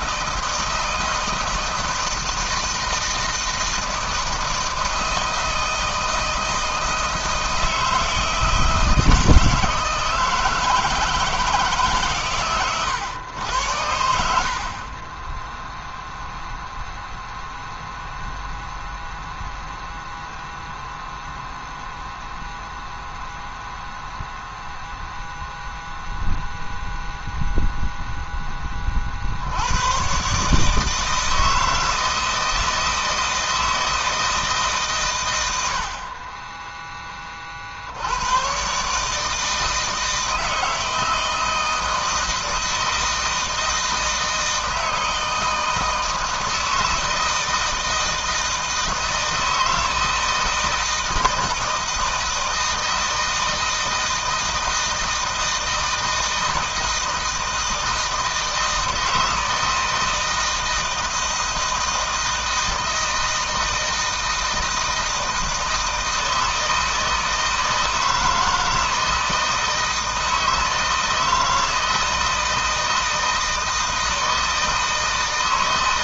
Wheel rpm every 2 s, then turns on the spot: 160, 160, 160, 160, 160, 160, 130, 60, 0, 0, 0, 0, 0, 0, 10, 140, 160, 160, 30, 110, 160, 160, 160, 160, 160, 160, 160, 160, 160, 160, 160, 160, 160, 160, 160, 160, 160, 160.
none